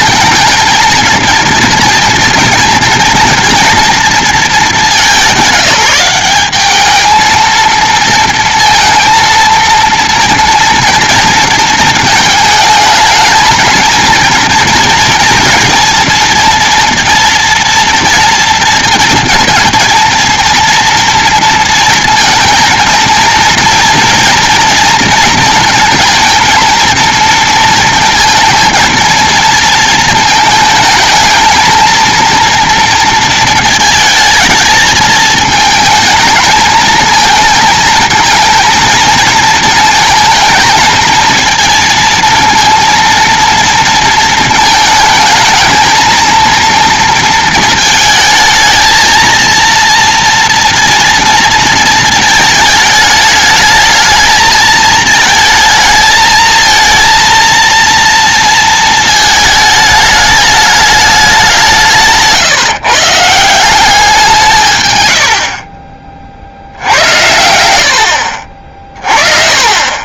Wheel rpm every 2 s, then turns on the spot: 220, 230, 210, 200, 230, 230, 220, 230, 230, 230, 230, 230, 240, 230, 230, 220, 230, 220, 220, 230, 220, 230, 220, 230, 220, 230, 220, 220, 220, 230, 210, 150, 170, 60, 50.
none